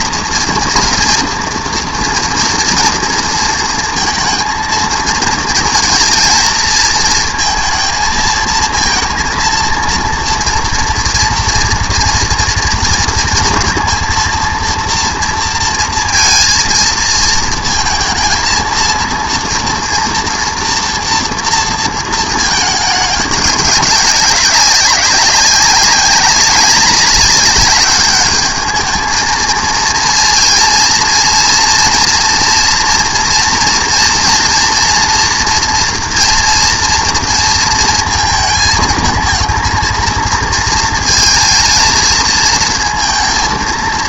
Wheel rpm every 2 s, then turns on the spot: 230, 240, 230, 230, 230, 240, 230, 230, 230, 230, 230, 210, 200, 200, 210, 230, 230, 230, 230, 220, 230, 230.
none